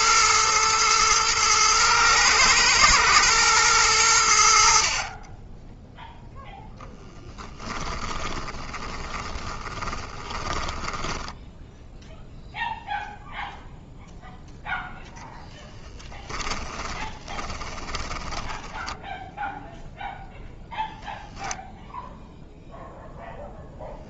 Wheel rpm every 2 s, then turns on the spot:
120, 110, 60, 10, 20, 10, 0, 0, 20, 10, 0, 0.
8-12 16-18